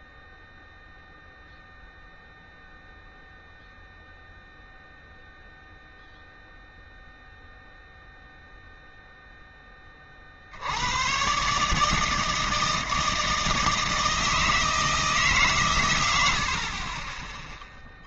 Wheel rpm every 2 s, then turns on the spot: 0, 0, 0, 0, 0, 60, 160, 160, 80.
none